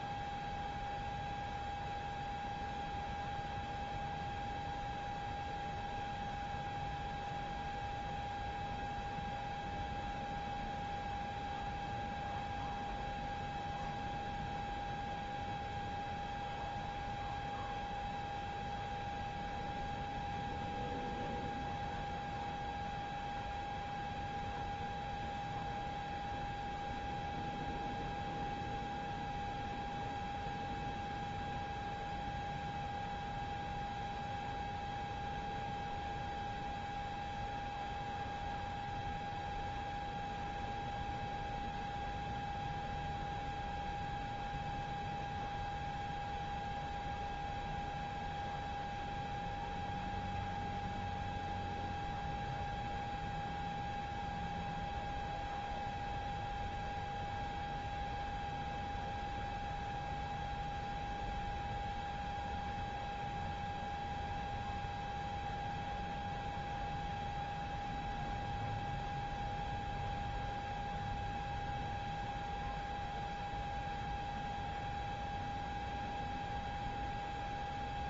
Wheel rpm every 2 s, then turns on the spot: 0, 0, 0, 0, 0, 0, 0, 0, 0, 0, 0, 0, 0, 0, 0, 0, 0, 0, 0, 0, 0, 0, 0, 0, 0, 0, 0, 0, 0, 0, 0, 0, 0, 0, 0, 0, 0, 0, 0.
none